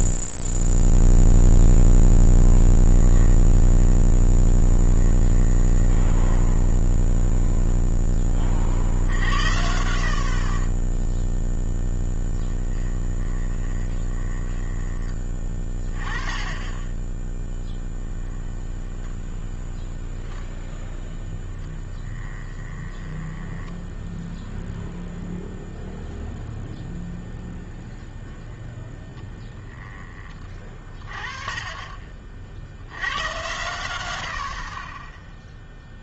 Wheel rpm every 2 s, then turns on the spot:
0, 0, 10, 20, 10, 50, 10, 20, 20, 10, 0, 20, 0, 0, 0, 30, 50, 50.
4-8 12-16 18-20 22-24 34-36